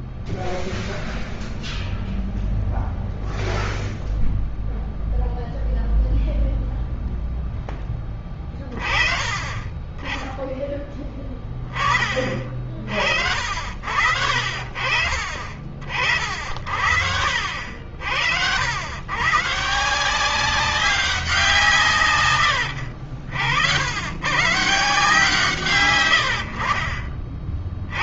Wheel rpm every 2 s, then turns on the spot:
0, 0, 0, 30, 20, 60, 60, 60, 90, 190, 80, 130, 60, 70.
26-28